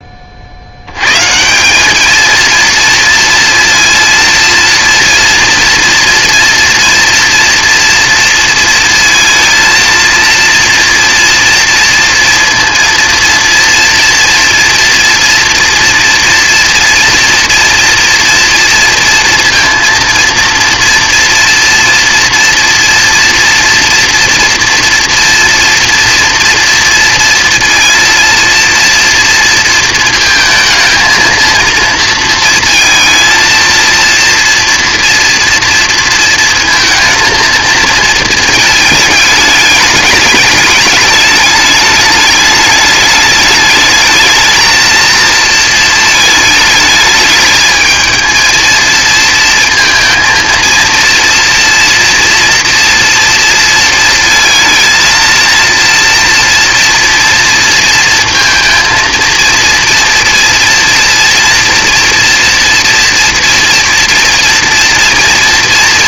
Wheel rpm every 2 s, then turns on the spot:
80, 230, 230, 230, 230, 230, 230, 230, 230, 230, 230, 230, 230, 230, 230, 220, 220, 230, 230, 220, 210, 210, 220, 210, 230, 230, 230, 230, 230, 230, 230, 230, 230.
none